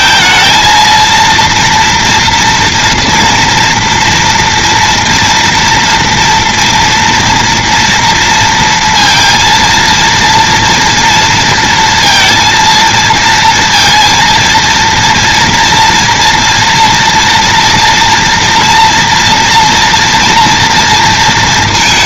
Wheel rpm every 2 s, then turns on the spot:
230, 230, 230, 230, 230, 230, 230, 230, 240, 230, 230.
none